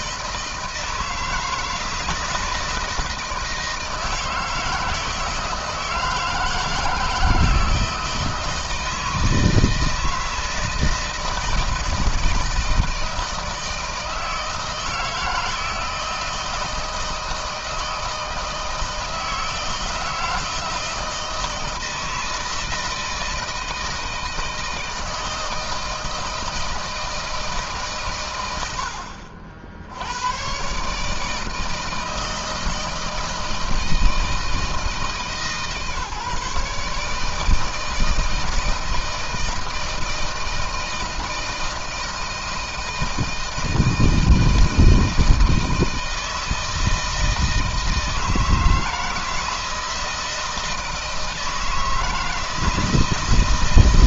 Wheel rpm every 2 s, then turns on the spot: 170, 160, 160, 160, 160, 160, 160, 160, 160, 160, 160, 160, 160, 160, 90, 140, 160, 160, 150, 160, 160, 160, 160, 160, 160, 160, 160.
none